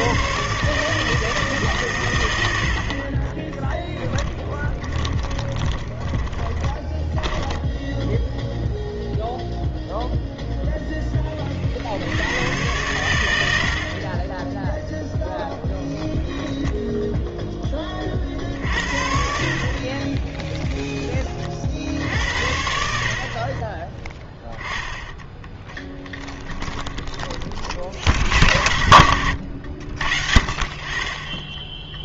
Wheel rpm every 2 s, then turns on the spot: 140, 70, 20, 10, 0, 0, 100, 10, 10, 50, 0, 60, 10, 20, 70, 40.
4-8 26-28